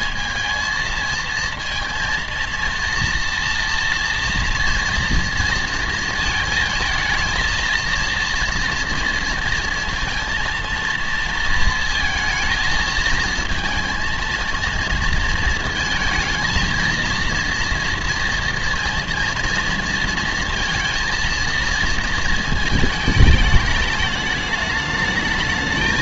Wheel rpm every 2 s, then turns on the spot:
220, 230, 230, 220, 230, 230, 220, 220, 230, 230, 230, 220, 210.
none